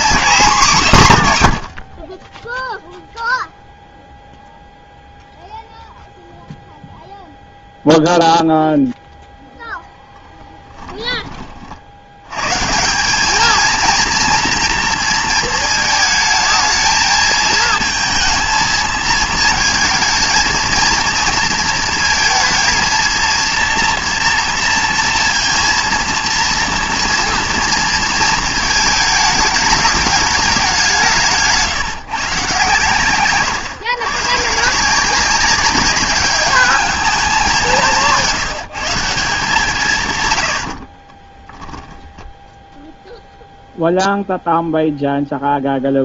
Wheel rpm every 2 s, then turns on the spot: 200, 0, 0, 0, 0, 10, 190, 230, 220, 220, 230, 230, 230, 240, 220, 170, 130, 170, 210, 170, 40, 0, 0.
40-42